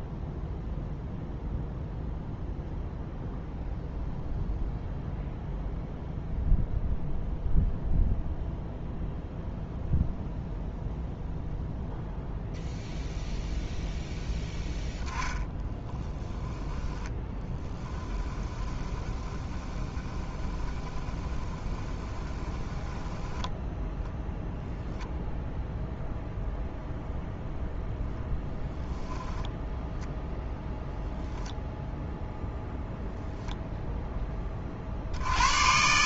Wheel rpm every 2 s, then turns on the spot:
0, 0, 0, 0, 0, 0, 0, 0, 10, 20, 20, 10, 0, 0, 0, 0, 0, 40.
18-24